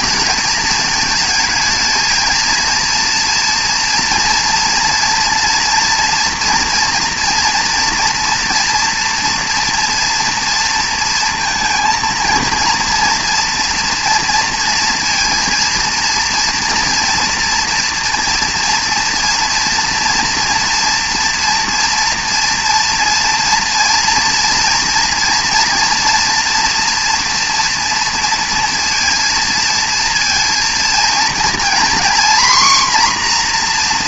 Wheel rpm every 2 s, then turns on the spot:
220, 230, 230, 230, 240, 230, 230, 230, 230, 230, 230, 230, 230, 240, 230, 230, 250.
none